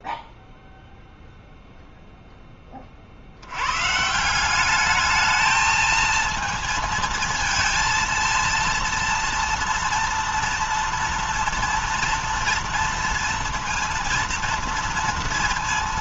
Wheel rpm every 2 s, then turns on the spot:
0, 20, 190, 230, 230, 230, 230, 230.
none